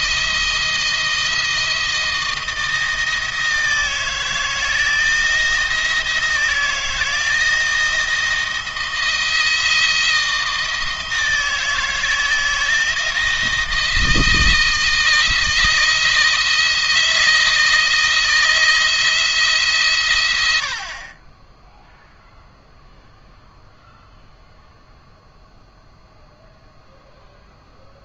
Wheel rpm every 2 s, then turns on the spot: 160, 160, 170, 160, 160, 160, 160, 160, 160, 160, 50, 0, 0, 0.
none